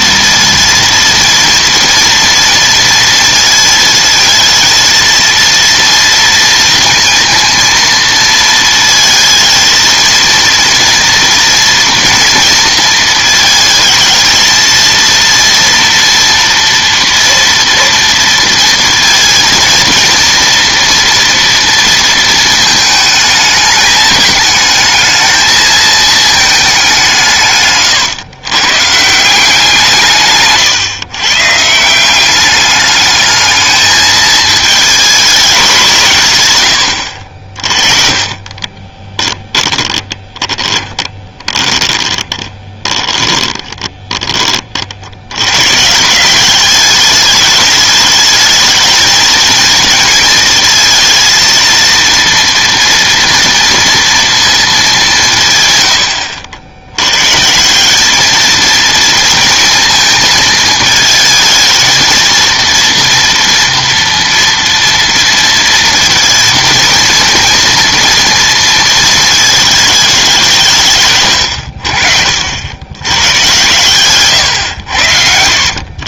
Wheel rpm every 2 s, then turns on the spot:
230, 230, 230, 230, 220, 230, 230, 230, 230, 230, 230, 220, 220, 210, 120, 140, 200, 220, 100, 30, 20, 30, 30, 200, 220, 220, 230, 220, 70, 220, 220, 230, 230, 230, 230, 170, 80, 110.
38-44